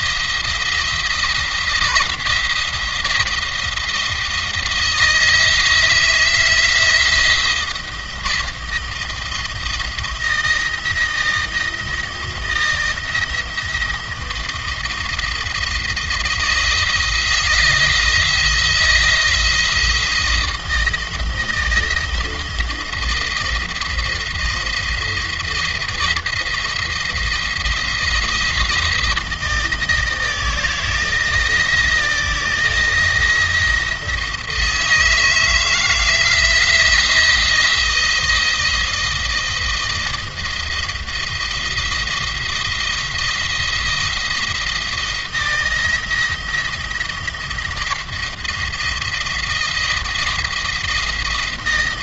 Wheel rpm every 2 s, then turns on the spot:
170, 170, 160, 170, 170, 170, 170, 170, 160, 160, 160, 160, 170, 170, 170, 170, 170, 170, 170, 160, 170, 170, 170, 170, 170, 170.
none